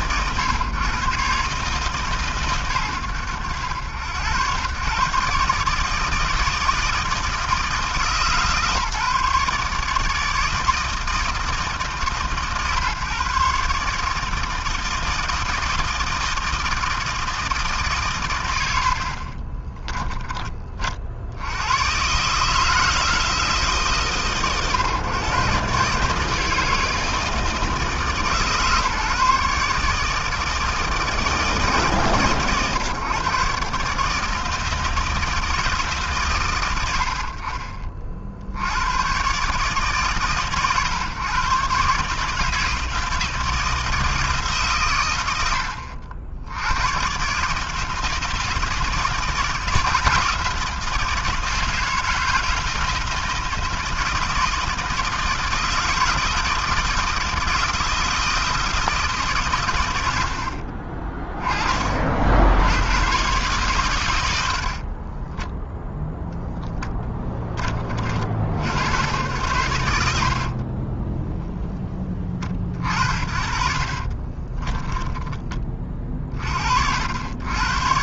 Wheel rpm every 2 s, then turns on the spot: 140, 100, 140, 160, 150, 160, 140, 160, 160, 40, 80, 160, 140, 160, 150, 150, 140, 160, 60, 130, 130, 160, 100, 140, 160, 160, 160, 160, 160, 150, 20, 140, 20, 20, 90, 0, 50, 10, 80.
64-66 74-76